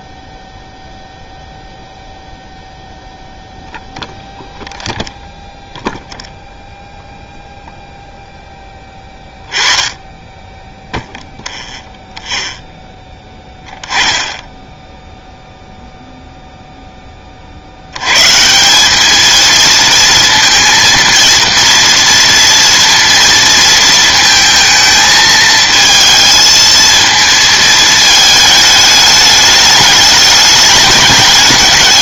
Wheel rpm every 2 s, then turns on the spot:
0, 0, 0, 0, 20, 0, 0, 0, 50, 220, 230, 230, 220, 220, 210, 210.
none